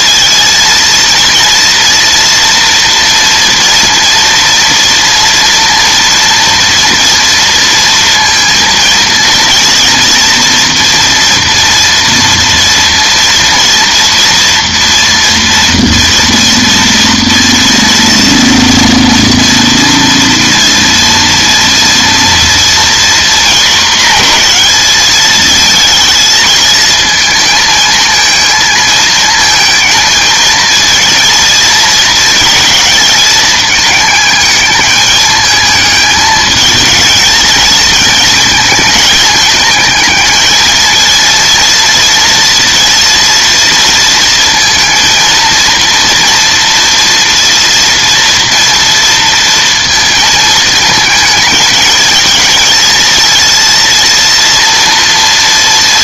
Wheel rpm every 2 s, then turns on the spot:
230, 230, 230, 230, 230, 230, 230, 240, 230, 230, 230, 230, 220, 220, 220, 230, 220, 210, 220, 220, 220, 230, 220, 230, 230, 220, 230, 230.
none